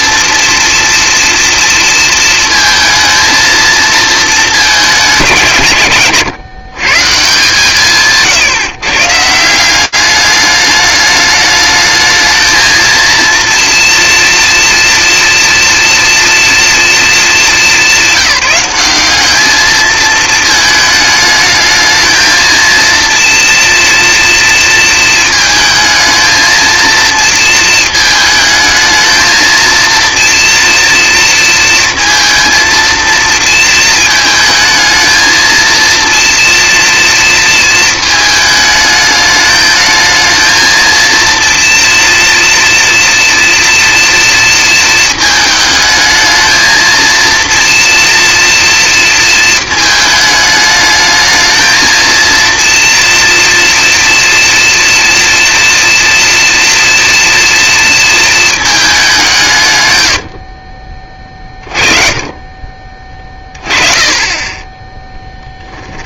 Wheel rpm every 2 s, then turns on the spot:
240, 230, 210, 140, 140, 210, 230, 230, 230, 200, 220, 230, 230, 230, 220, 230, 230, 230, 230, 210, 230, 230, 230, 230, 230, 220, 230, 240, 230, 210, 30, 30, 10.
none